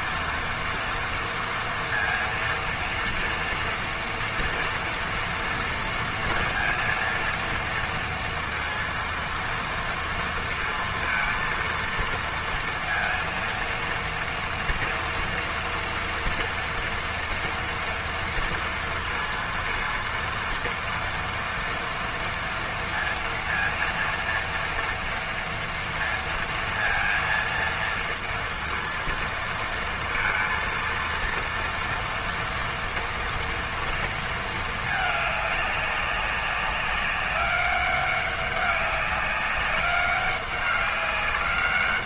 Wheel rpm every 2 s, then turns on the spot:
230, 230, 240, 230, 230, 230, 230, 230, 230, 230, 230, 230, 240, 230, 230, 230, 230, 210, 200, 200, 200.
none